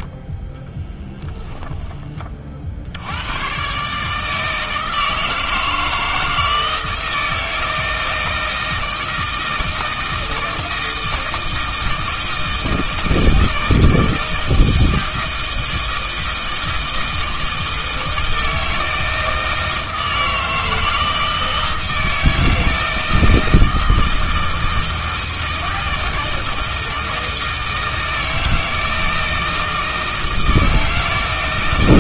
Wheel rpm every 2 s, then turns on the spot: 10, 70, 160, 160, 160, 160, 160, 160, 160, 160, 160, 160, 160, 160, 160, 160.
none